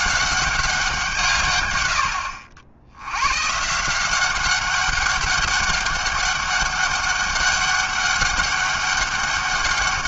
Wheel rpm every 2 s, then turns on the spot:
190, 80, 200, 200, 190.
none